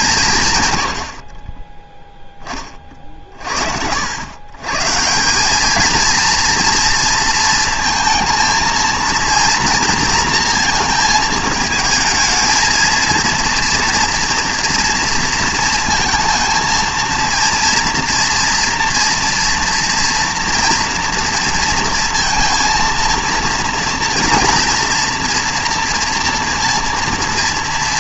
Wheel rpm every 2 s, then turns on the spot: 150, 20, 120, 240, 230, 230, 220, 230, 230, 230, 230, 230, 230, 230.
none